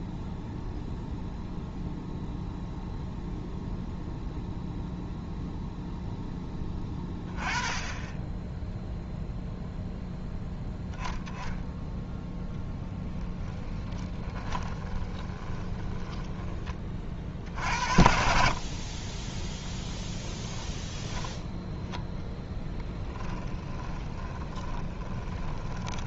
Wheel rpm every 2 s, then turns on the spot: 0, 0, 0, 10, 0, 0, 10, 20, 30, 40, 20, 10, 30.
12-16 20-26